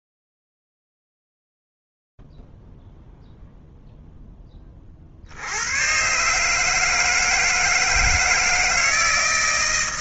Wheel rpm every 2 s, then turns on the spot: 0, 0, 0, 120, 160.
none